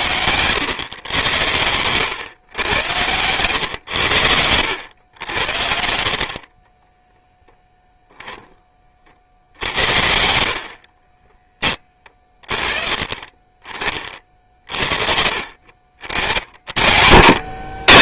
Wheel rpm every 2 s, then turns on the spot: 120, 100, 100, 40, 10, 50, 30, 50, 70.
6-8